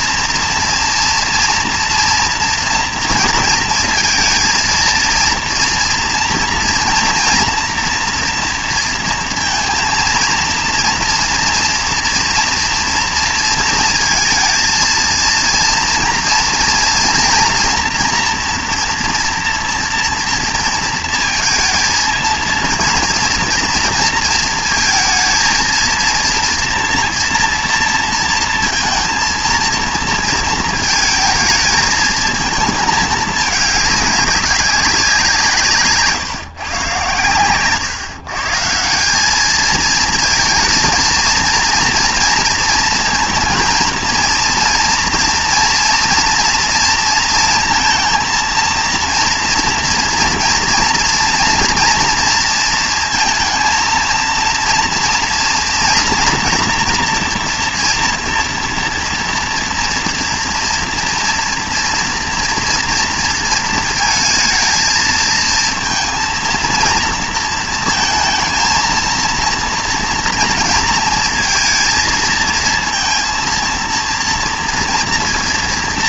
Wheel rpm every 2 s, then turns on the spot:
240, 230, 230, 230, 230, 230, 230, 230, 230, 240, 230, 230, 220, 230, 230, 220, 220, 200, 140, 150, 230, 230, 230, 230, 230, 230, 230, 230, 230, 240, 230, 230, 220, 230, 230, 230, 230, 230.
none